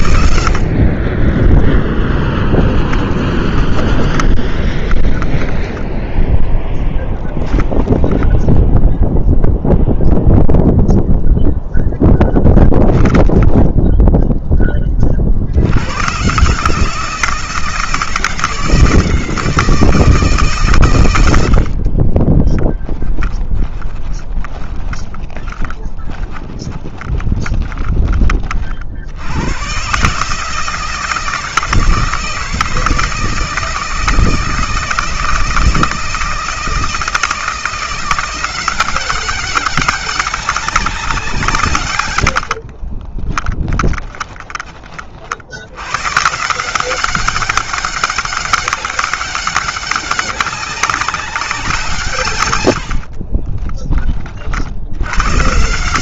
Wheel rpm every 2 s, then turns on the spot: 40, 20, 20, 10, 0, 0, 10, 40, 160, 160, 110, 10, 20, 20, 60, 160, 160, 160, 160, 190, 180, 40, 40, 190, 200, 200, 70, 90.
0-8 12-14 22-28 42-44 52-54